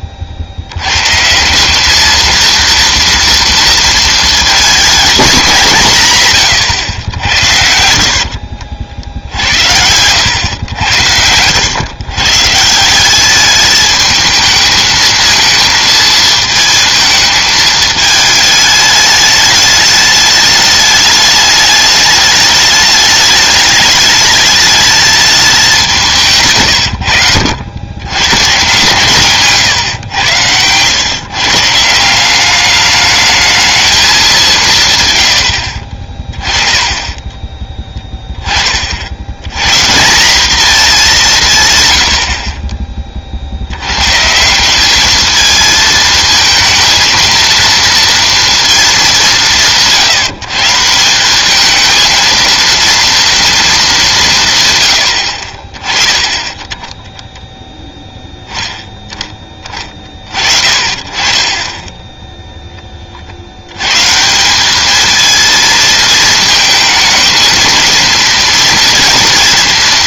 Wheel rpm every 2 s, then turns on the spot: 100, 230, 240, 120, 60, 100, 170, 220, 220, 210, 210, 210, 220, 110, 140, 110, 210, 150, 20, 50, 210, 30, 190, 230, 220, 160, 230, 140, 20, 10, 40, 20, 210, 220, 230.
6-8